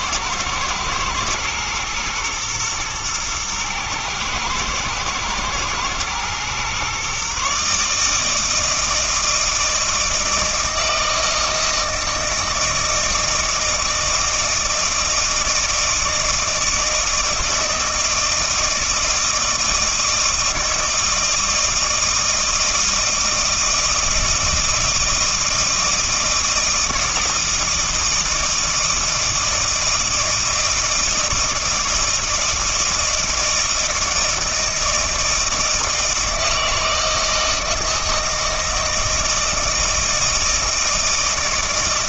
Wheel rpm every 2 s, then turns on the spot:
110, 110, 110, 130, 160, 160, 160, 160, 160, 160, 160, 160, 160, 160, 160, 160, 160, 160, 160, 160, 160.
none